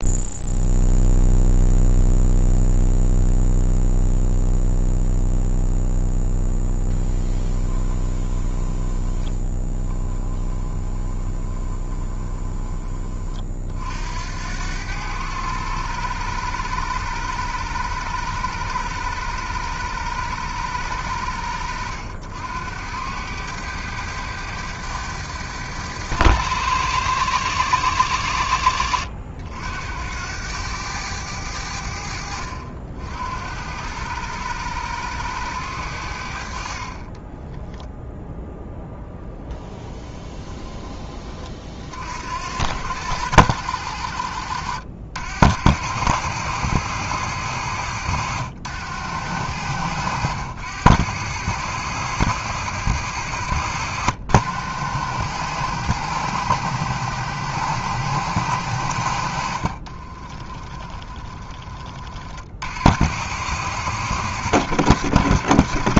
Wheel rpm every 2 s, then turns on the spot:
0, 0, 0, 0, 20, 10, 20, 80, 100, 100, 100, 80, 100, 100, 90, 90, 70, 100, 70, 0, 10, 70, 80, 100, 90, 90, 100, 80, 100, 100, 30, 50, 100.
8-14 40-42 60-62